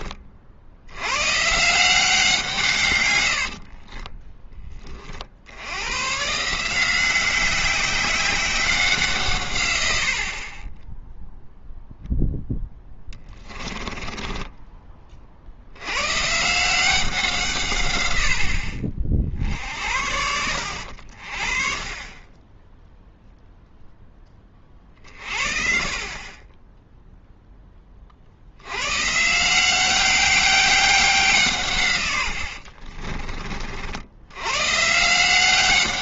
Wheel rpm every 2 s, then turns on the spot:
80, 130, 20, 170, 180, 10, 10, 20, 170, 60, 70, 10, 30, 10, 100, 190, 40, 140.
12-14 32-34